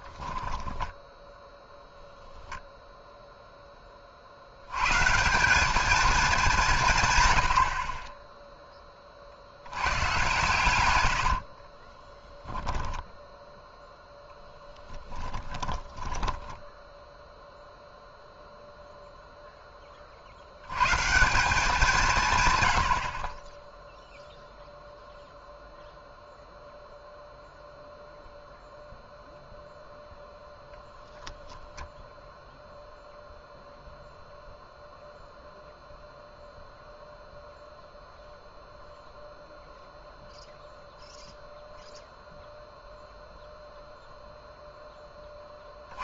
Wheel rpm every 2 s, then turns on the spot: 10, 0, 90, 170, 0, 110, 10, 10, 10, 0, 100, 100, 0, 0, 0, 10, 0, 0, 0, 0, 0, 0, 0.
0-2 12-18